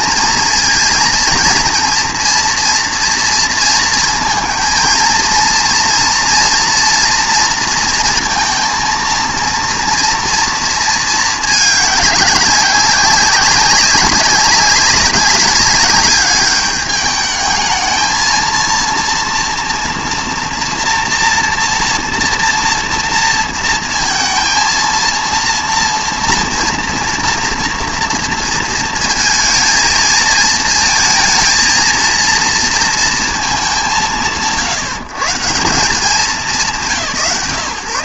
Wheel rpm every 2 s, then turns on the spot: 230, 230, 230, 230, 230, 230, 190, 200, 210, 230, 230, 240, 230, 230, 230, 230, 230, 120, 160.
none